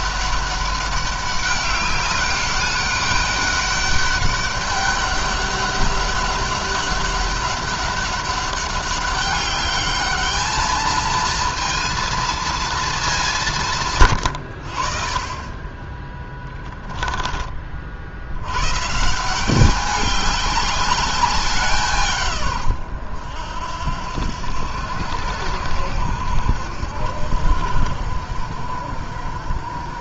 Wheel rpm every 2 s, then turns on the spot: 200, 200, 200, 200, 200, 220, 230, 90, 10, 110, 200, 120, 80, 80, 60.
16-18